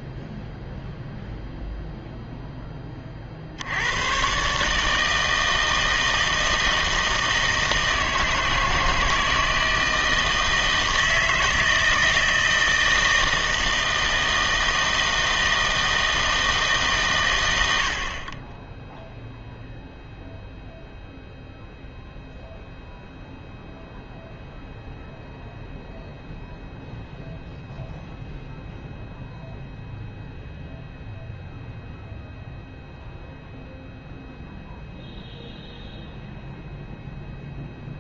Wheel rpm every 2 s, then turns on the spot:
0, 10, 150, 160, 160, 160, 160, 160, 150, 10, 0, 0, 0, 0, 0, 0, 0, 0, 0.
none